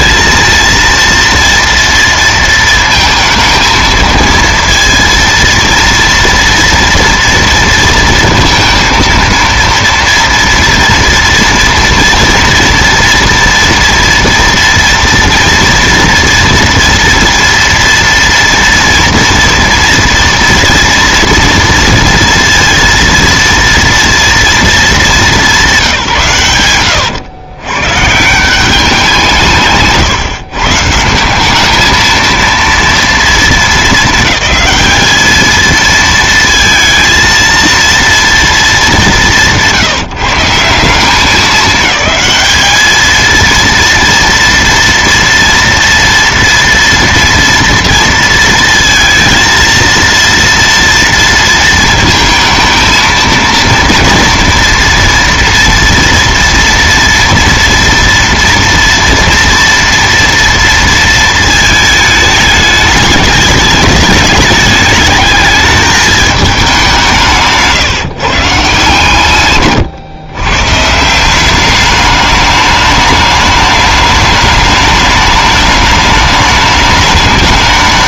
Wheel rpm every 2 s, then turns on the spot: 230, 230, 230, 230, 230, 230, 230, 230, 230, 240, 230, 230, 220, 110, 180, 150, 230, 210, 230, 220, 160, 210, 240, 230, 230, 230, 220, 230, 230, 240, 230, 210, 210, 200, 140, 130, 210, 210, 210.
26-28